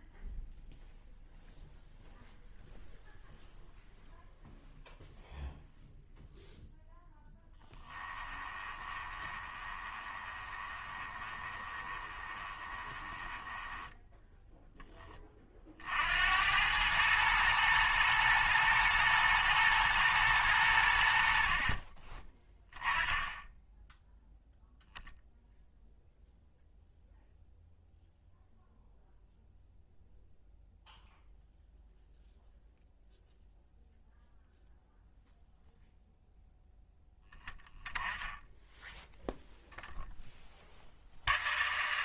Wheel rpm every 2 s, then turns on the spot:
0, 0, 0, 0, 20, 20, 20, 10, 100, 110, 90, 10, 0, 0, 0, 0, 0, 0, 0, 0, 60.
8-14